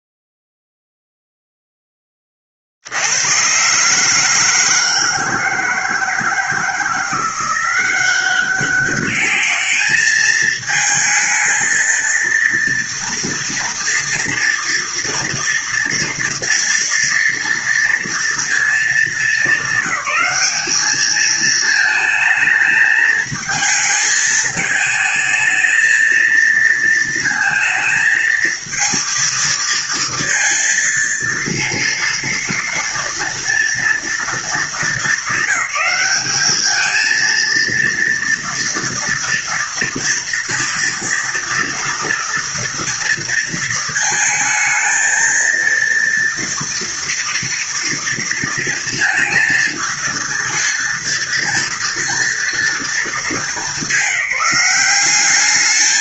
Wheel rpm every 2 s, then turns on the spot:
0, 40, 160, 160, 190, 220, 230, 230, 230, 220, 200, 220, 220, 230, 220, 230, 230, 220, 200, 230, 230, 230, 220, 230, 230, 230, 230, 200.
none